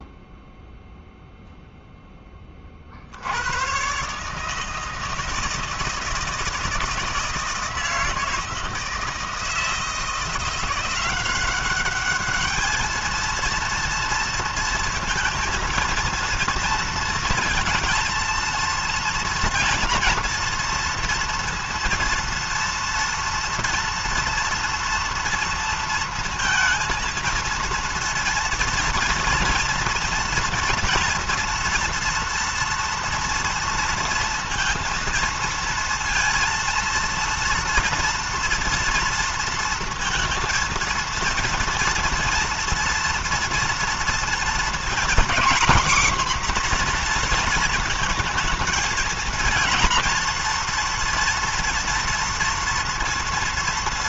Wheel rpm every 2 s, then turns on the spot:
0, 40, 160, 160, 160, 170, 210, 230, 230, 230, 230, 230, 230, 230, 230, 230, 230, 230, 230, 230, 230, 240, 240, 250, 230, 230, 230.
none